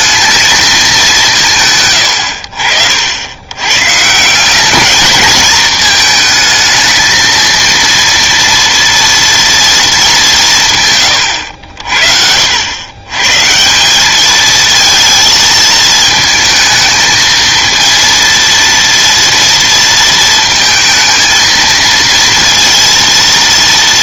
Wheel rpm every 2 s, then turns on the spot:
210, 80, 190, 220, 230, 150, 80, 220, 220, 230, 220, 230.
none